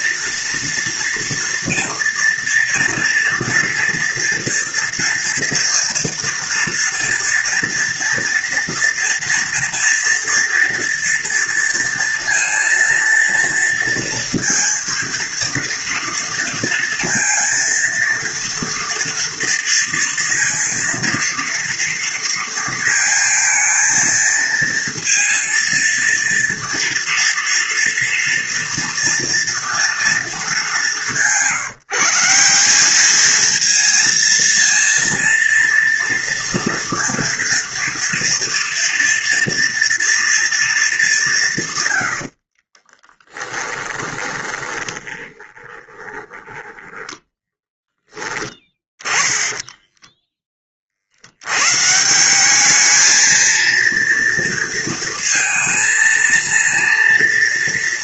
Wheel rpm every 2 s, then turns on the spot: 230, 230, 230, 230, 240, 230, 230, 230, 230, 230, 230, 230, 230, 230, 230, 200, 200, 230, 230, 230, 210, 40, 20, 20, 20, 30, 210, 230, 230.
42-50